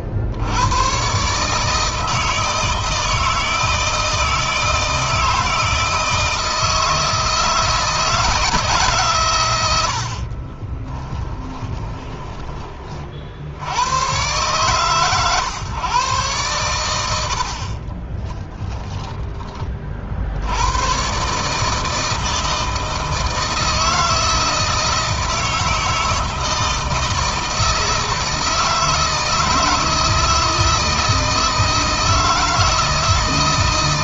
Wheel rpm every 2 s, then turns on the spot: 100, 160, 160, 160, 160, 30, 40, 130, 90, 20, 120, 160, 160, 160, 160, 160, 160.
10-12 18-20